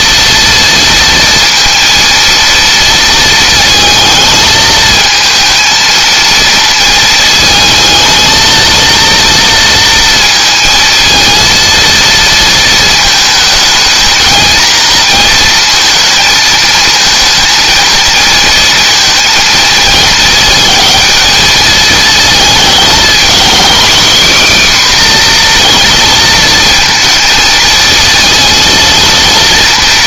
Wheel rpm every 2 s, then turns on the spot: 230, 230, 220, 220, 230, 230, 230, 230, 220, 230, 230, 230, 270, 230, 230.
none